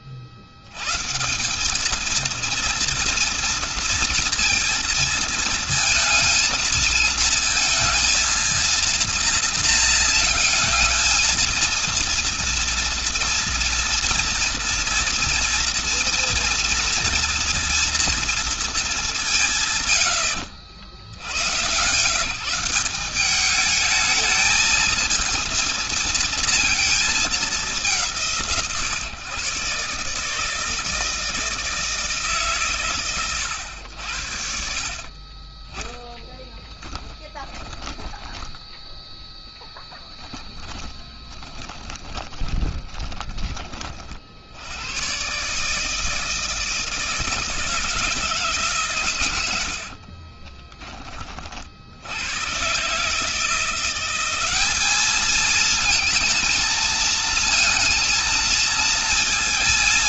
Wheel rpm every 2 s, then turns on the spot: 70, 230, 230, 230, 230, 220, 230, 230, 230, 230, 90, 160, 220, 230, 150, 160, 150, 70, 10, 10, 10, 20, 80, 160, 150, 30, 100, 200, 230, 230.
36-44 50-52